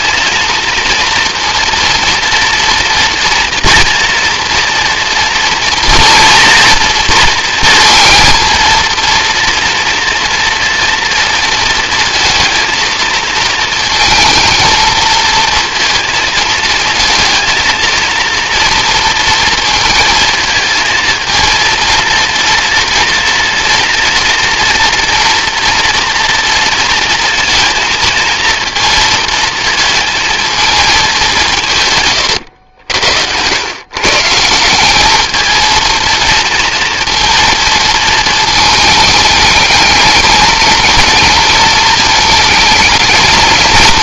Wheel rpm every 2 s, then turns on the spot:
230, 240, 230, 230, 230, 230, 230, 230, 230, 230, 220, 230, 230, 230, 220, 210, 90, 190, 230, 220, 230, 220.
none